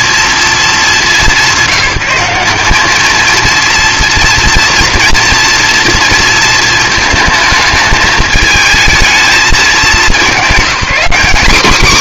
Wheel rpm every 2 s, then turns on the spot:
210, 190, 230, 220, 220, 220.
none